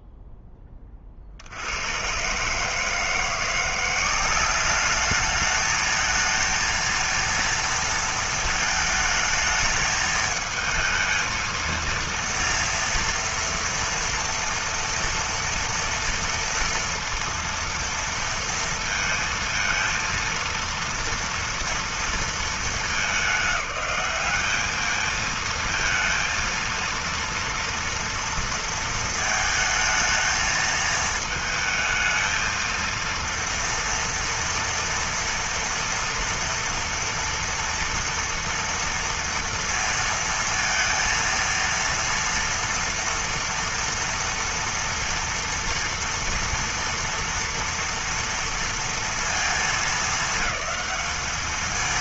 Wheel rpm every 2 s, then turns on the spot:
30, 150, 200, 220, 220, 220, 230, 230, 230, 230, 230, 220, 210, 230, 230, 220, 230, 230, 230, 230, 230, 230, 230, 240, 230, 220.
none